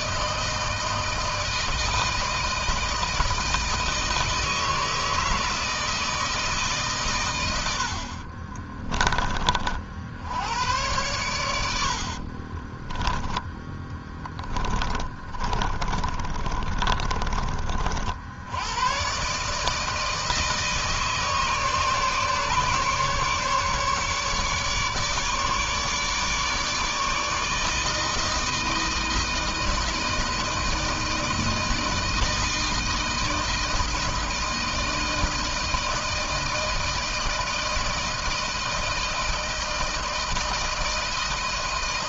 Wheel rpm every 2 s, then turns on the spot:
160, 160, 160, 140, 30, 110, 20, 20, 30, 100, 150, 140, 150, 150, 160, 160, 160, 160, 160, 160, 160.
8-10 12-18